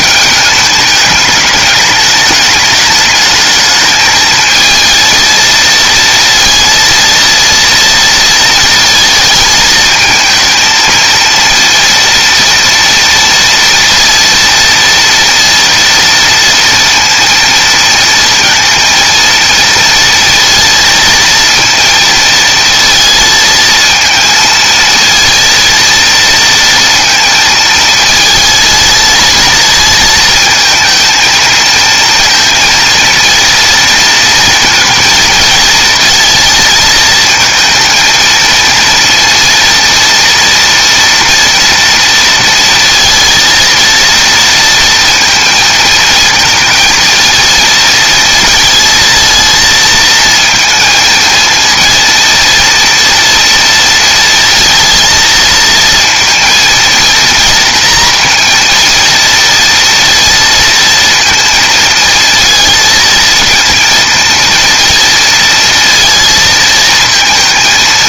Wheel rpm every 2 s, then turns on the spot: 210, 210, 220, 230, 230, 220, 230, 230, 230, 230, 230, 230, 230, 230, 220, 220, 230, 230, 220, 230, 230, 230, 230, 220, 230, 230, 230, 230, 230, 230, 230, 230, 230, 230.
none